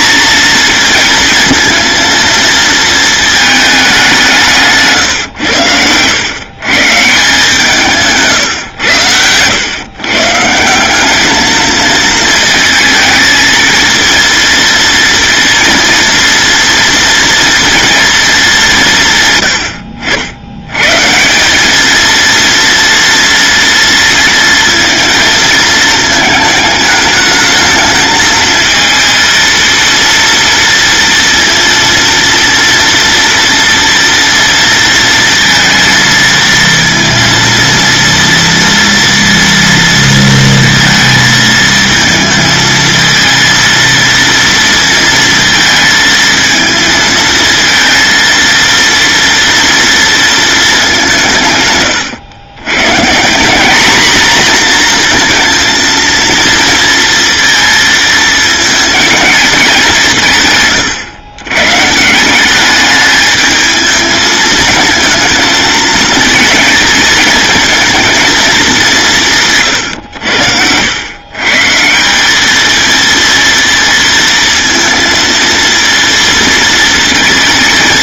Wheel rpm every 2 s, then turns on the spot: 220, 220, 140, 150, 100, 190, 220, 230, 230, 170, 140, 230, 230, 220, 230, 230, 230, 230, 230, 230, 230, 220, 230, 220, 230, 200, 140, 240, 230, 220, 110, 210, 220, 220, 190, 110, 220, 220, 230.
none